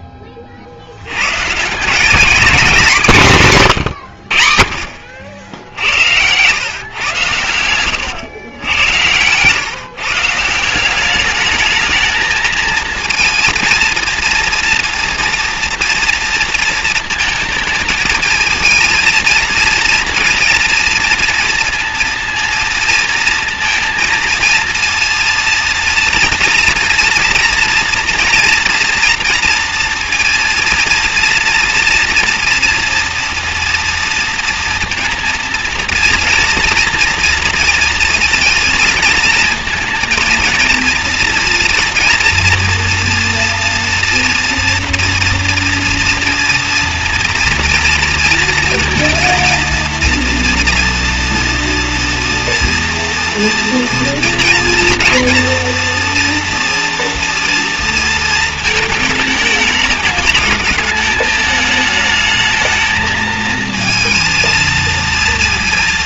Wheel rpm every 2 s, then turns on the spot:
50, 210, 50, 120, 100, 170, 220, 230, 230, 230, 230, 230, 230, 240, 240, 230, 230, 230, 230, 230, 230, 230, 230, 230, 230, 230, 230, 230, 230, 220, 210, 220, 230.
none